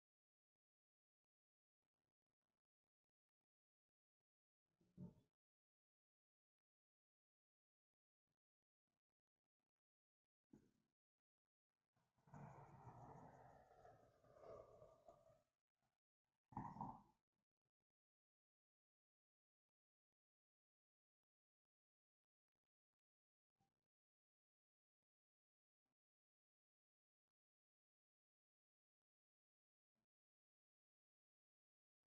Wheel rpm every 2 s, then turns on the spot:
0, 0, 0, 0, 0, 0, 0, 0, 0, 0, 0, 0, 0, 0, 0, 0.
none